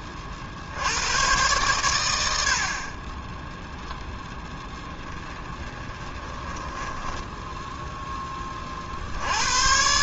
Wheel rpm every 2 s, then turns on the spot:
70, 50, 10, 10, 40.
6-8